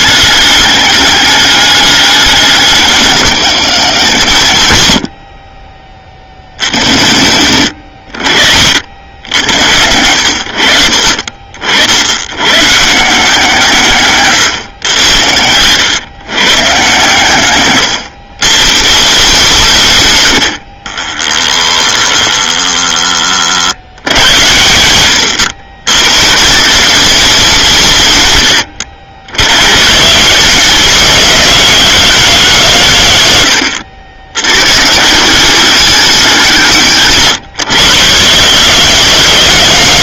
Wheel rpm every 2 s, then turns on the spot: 200, 190, 70, 100, 80, 50, 160, 80, 130, 160, 20, 20, 100, 190, 90, 210, 140, 160, 140, 190.
20-22